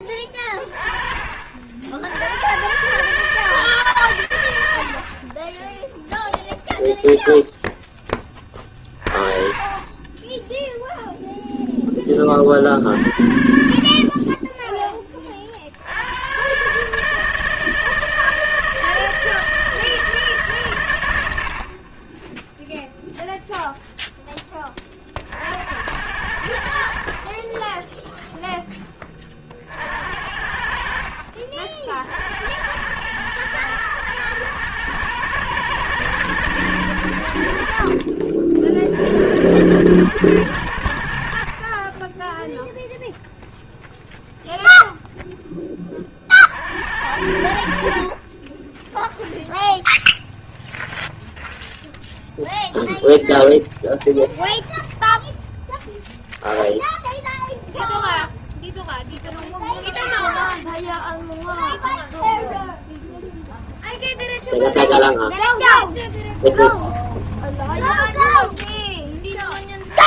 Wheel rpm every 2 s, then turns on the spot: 30, 110, 100, 0, 30, 0, 60, 20, 150, 160, 100, 0, 40, 60, 20, 40, 110, 110, 80, 60, 70, 0, 0, 80, 10, 0, 0, 0, 0, 0, 0, 0, 0, 0, 0.
none